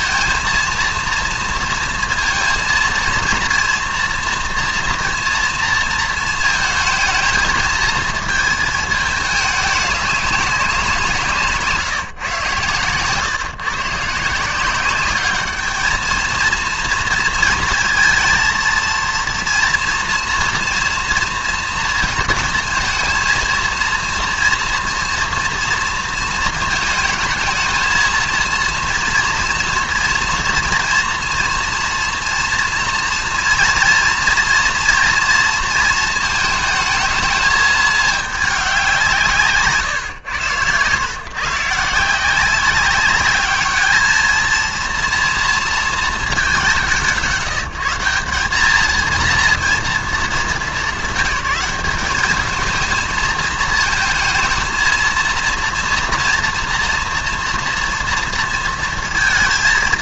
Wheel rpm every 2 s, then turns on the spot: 230, 230, 230, 220, 220, 190, 120, 180, 230, 230, 230, 230, 230, 220, 230, 230, 240, 230, 220, 200, 110, 190, 220, 180, 200, 200, 200, 220, 230, 230.
none